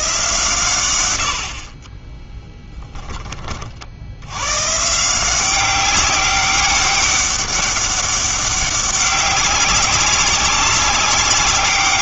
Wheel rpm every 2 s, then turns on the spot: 120, 10, 130, 200, 200, 200.
none